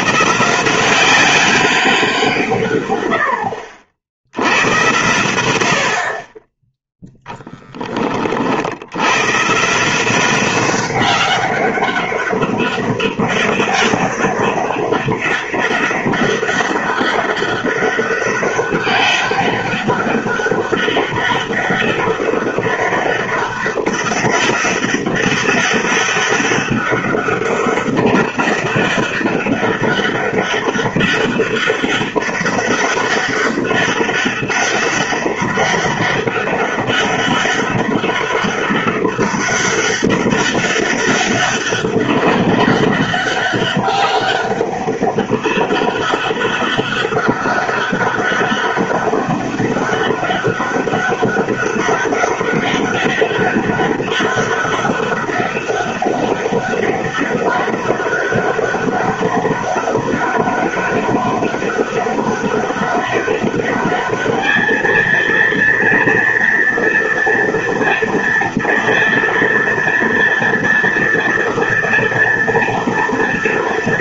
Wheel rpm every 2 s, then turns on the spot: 180, 130, 100, 10, 60, 190, 200, 200, 200, 200, 200, 200, 200, 200, 200, 200, 200, 200, 200, 200, 200, 200, 200, 200, 200, 200, 200, 200, 200, 200, 200, 200, 220, 230, 230, 240, 230.
none